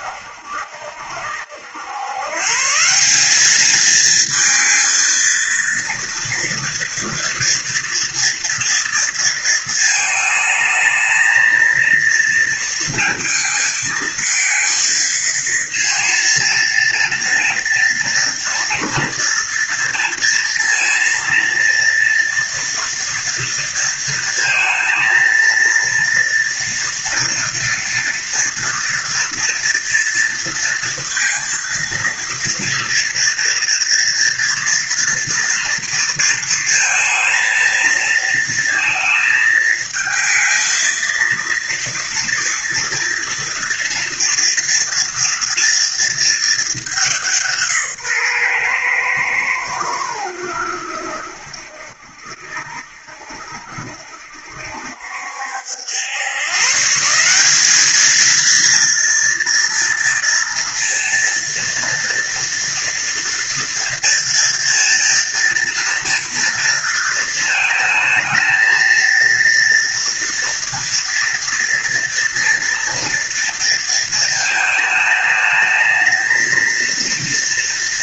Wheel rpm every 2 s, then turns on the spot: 70, 130, 230, 230, 230, 220, 230, 220, 230, 240, 230, 230, 230, 230, 230, 230, 230, 230, 230, 230, 220, 230, 230, 220, 140, 90, 70, 70, 110, 220, 230, 240, 230, 230, 220, 230, 230, 220, 220.
none